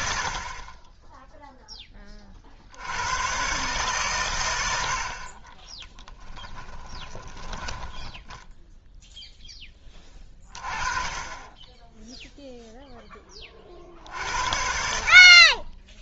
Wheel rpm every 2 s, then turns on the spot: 30, 50, 90, 20, 0, 30, 0, 60.
6-8